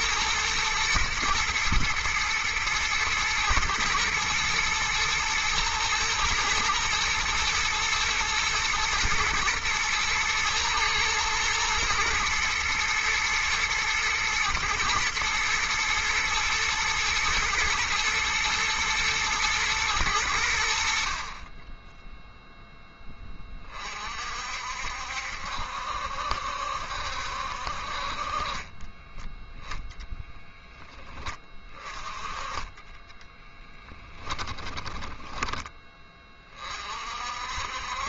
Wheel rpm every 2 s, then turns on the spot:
120, 110, 110, 110, 110, 110, 120, 120, 110, 120, 100, 10, 50, 70, 40, 0, 20, 20, 40.
32-36